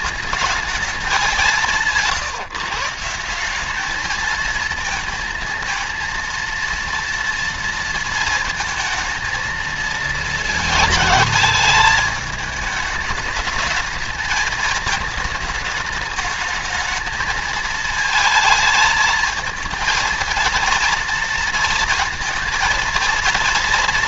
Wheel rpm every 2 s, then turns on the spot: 220, 150, 220, 230, 230, 220, 210, 220, 220, 220, 230, 230.
none